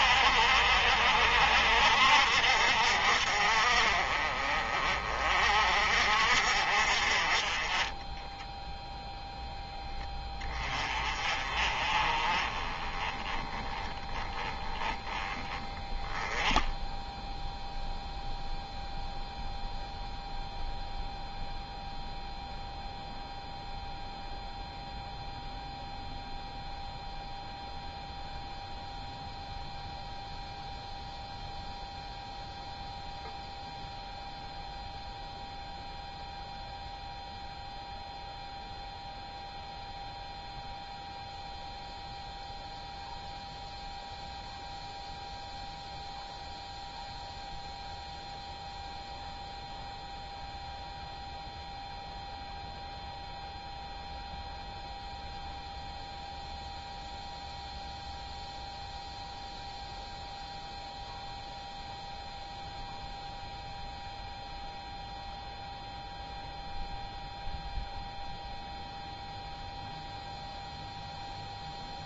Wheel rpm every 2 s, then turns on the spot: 60, 50, 40, 40, 0, 30, 20, 10, 0, 0, 0, 0, 0, 0, 0, 0, 0, 0, 0, 0, 0, 0, 0, 0, 0, 0, 0, 0, 0, 0, 0, 0, 0, 0, 0, 0.
none